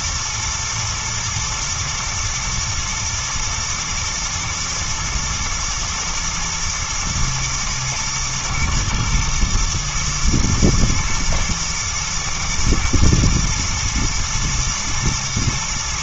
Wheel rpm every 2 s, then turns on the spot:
110, 110, 110, 110, 110, 110, 110, 110.
none